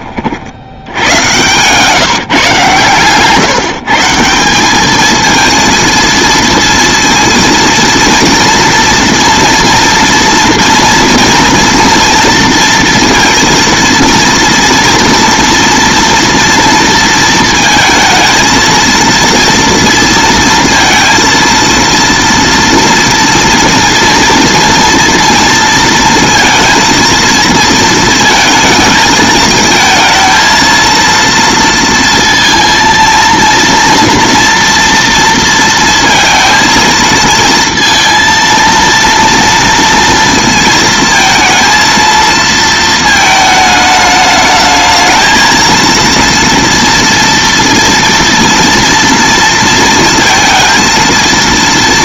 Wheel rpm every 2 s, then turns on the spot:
70, 140, 190, 230, 230, 230, 230, 230, 230, 230, 230, 230, 230, 230, 220, 230, 230, 230, 230, 230, 230, 230, 210, 230, 230, 230.
none